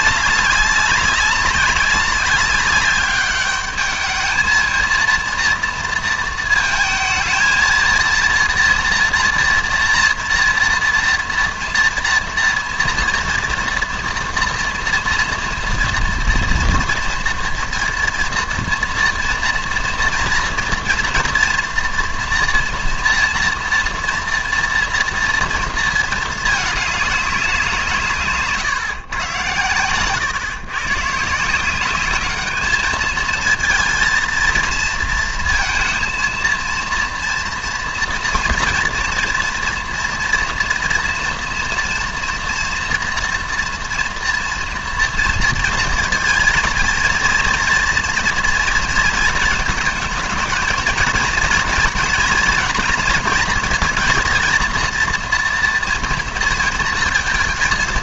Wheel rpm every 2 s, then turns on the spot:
200, 200, 220, 220, 240, 230, 230, 230, 230, 230, 230, 240, 240, 210, 150, 120, 210, 230, 230, 230, 230, 240, 230, 220, 230, 230, 230, 230, 230.
none